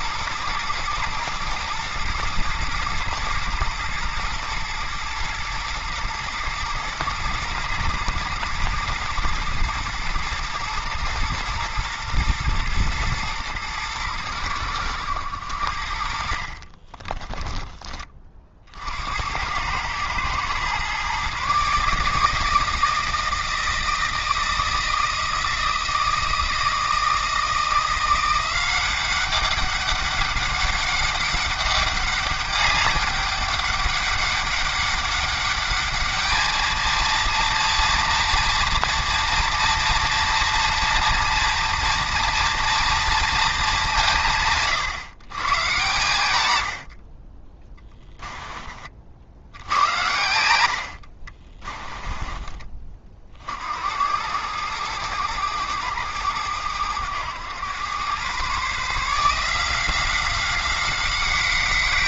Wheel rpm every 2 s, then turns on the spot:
110, 110, 110, 110, 110, 120, 110, 90, 30, 70, 130, 160, 160, 160, 190, 200, 200, 200, 220, 230, 230, 230, 130, 60, 50, 70, 40, 110, 100, 150, 190.
16-18